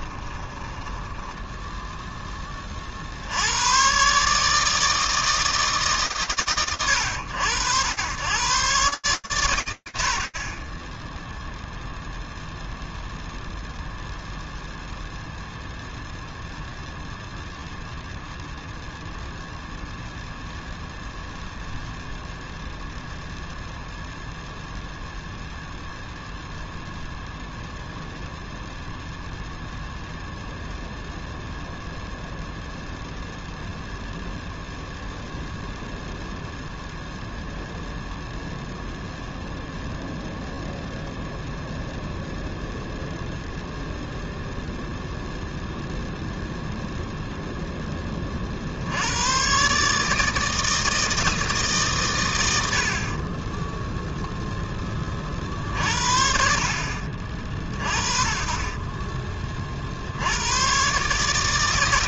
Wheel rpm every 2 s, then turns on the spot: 10, 20, 150, 100, 80, 0, 0, 0, 0, 0, 0, 0, 0, 0, 0, 0, 0, 0, 0, 0, 0, 0, 0, 0, 100, 160, 40, 30, 50, 30, 140.
0-2